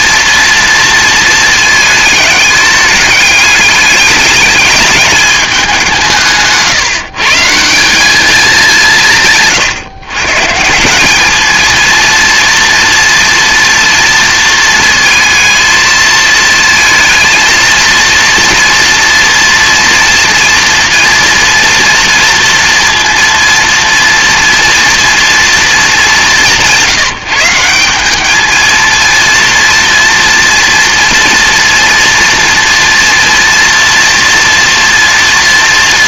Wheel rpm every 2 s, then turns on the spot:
230, 210, 210, 160, 180, 180, 230, 230, 220, 240, 240, 230, 230, 170, 220, 230, 230, 230.
none